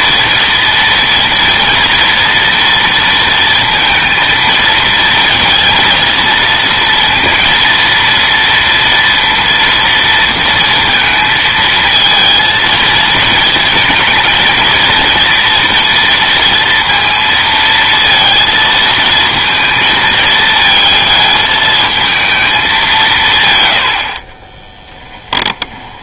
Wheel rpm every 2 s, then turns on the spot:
230, 230, 230, 230, 230, 230, 230, 230, 230, 220, 220, 200, 10.
24-26